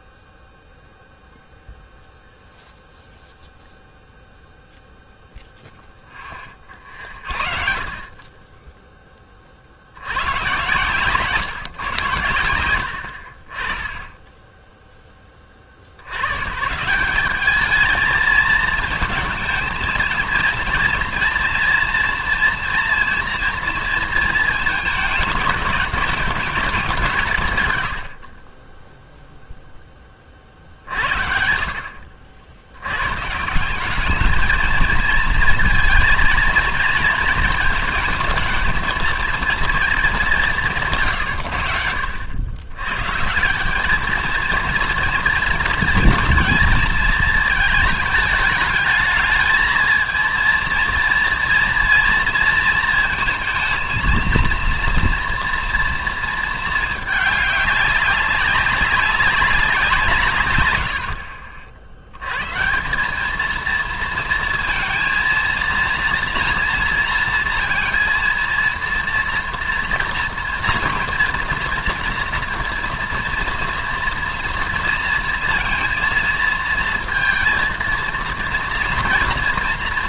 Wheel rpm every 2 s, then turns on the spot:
0, 0, 0, 50, 10, 150, 50, 10, 180, 220, 240, 230, 220, 180, 0, 60, 100, 220, 220, 220, 150, 120, 230, 230, 210, 230, 230, 230, 220, 200, 100, 140, 230, 240, 230, 230, 240, 230, 230, 230.
none